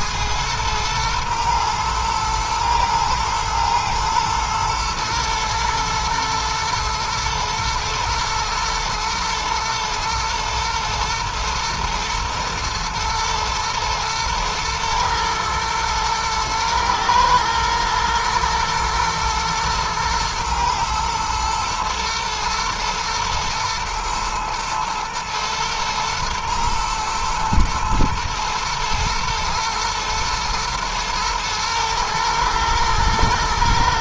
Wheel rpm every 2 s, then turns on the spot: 110, 110, 110, 110, 110, 120, 120, 110, 110, 110, 110, 110, 110, 110, 110, 120, 110.
none